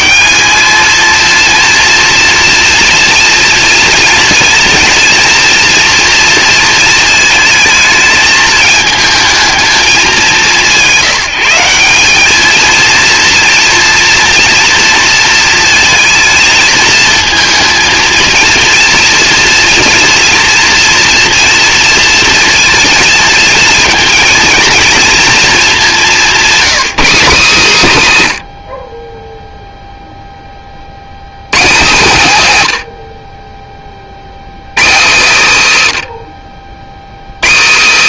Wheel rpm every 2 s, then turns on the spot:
220, 230, 230, 220, 220, 170, 230, 230, 220, 230, 230, 230, 230, 210, 70, 40, 110, 120, 60.
none